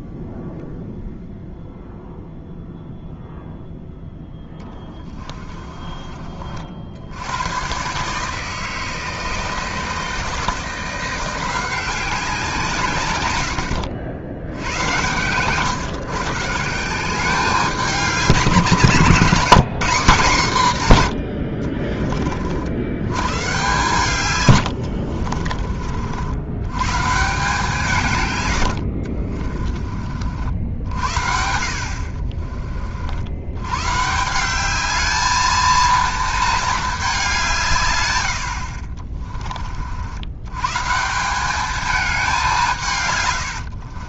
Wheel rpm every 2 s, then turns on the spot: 0, 0, 10, 60, 160, 170, 140, 110, 170, 160, 140, 80, 80, 110, 70, 70, 50, 210, 210, 40, 150, 150.
4-6 24-26 38-40 42-44